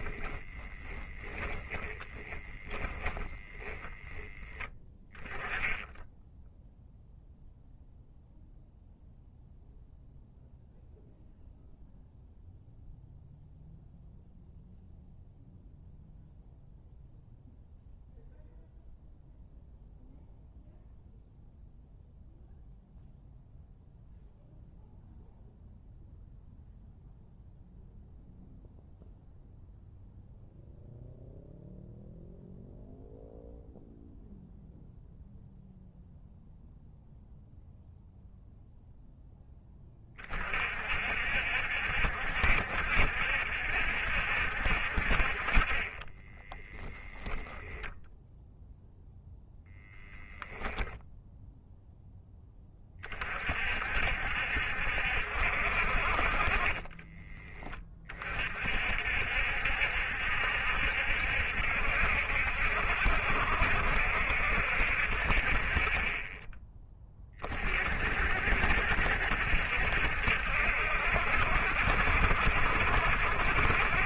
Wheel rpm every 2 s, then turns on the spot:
10, 10, 10, 0, 0, 0, 0, 0, 0, 0, 0, 0, 0, 0, 0, 0, 0, 0, 0, 0, 50, 70, 50, 10, 0, 0, 20, 60, 20, 60, 70, 70, 60, 20, 60, 70, 70.
0-4 56-58